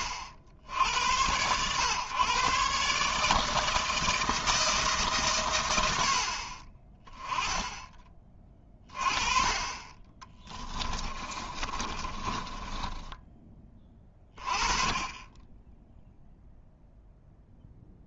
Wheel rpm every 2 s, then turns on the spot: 70, 140, 160, 40, 20, 20, 20, 30, 0.
10-14